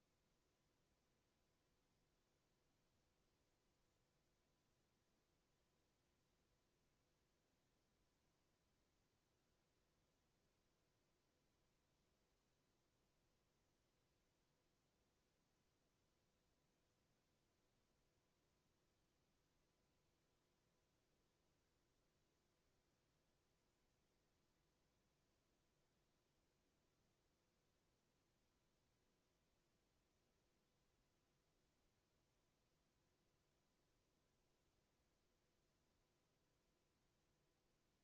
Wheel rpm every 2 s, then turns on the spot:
0, 0, 0, 0, 0, 0, 0, 0, 0, 0, 0, 0, 0, 0, 0, 0, 0, 0, 0.
none